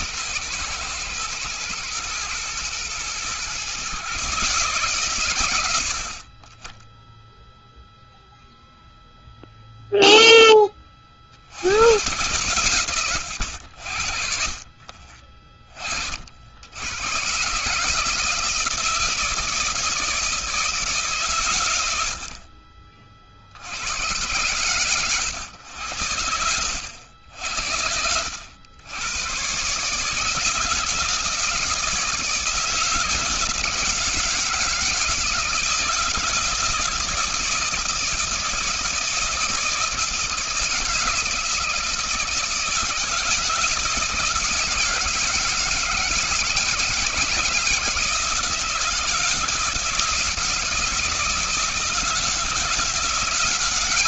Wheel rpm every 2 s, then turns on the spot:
120, 110, 130, 20, 0, 20, 110, 40, 80, 160, 150, 40, 120, 90, 90, 160, 160, 160, 160, 160, 160, 160, 160, 160, 160, 160, 170.
none